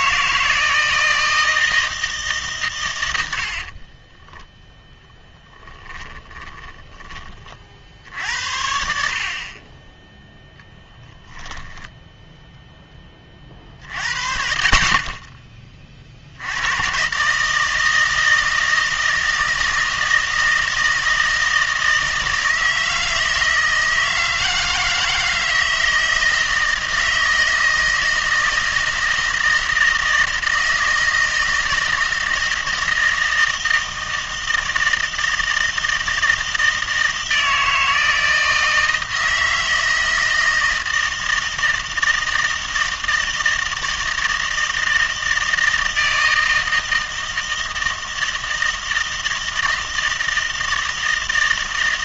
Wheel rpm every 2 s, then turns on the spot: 160, 130, 0, 20, 60, 10, 10, 40, 100, 160, 160, 160, 160, 160, 160, 160, 160, 160, 160, 160, 160, 160, 160, 160, 160, 160.
6-8 10-12